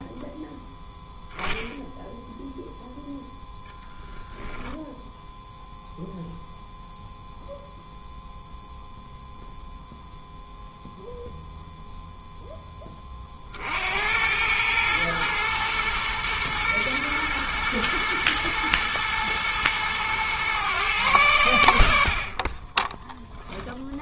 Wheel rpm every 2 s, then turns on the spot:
10, 0, 0, 0, 0, 0, 0, 100, 110, 110, 120, 30.
22-24